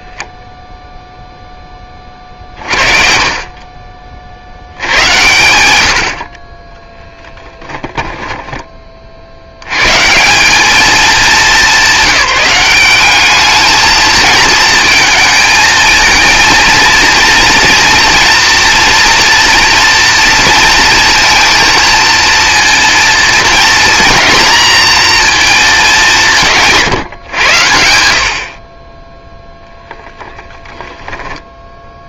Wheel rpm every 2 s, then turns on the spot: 0, 40, 80, 10, 20, 190, 200, 220, 230, 230, 230, 230, 230, 160, 30, 10.
none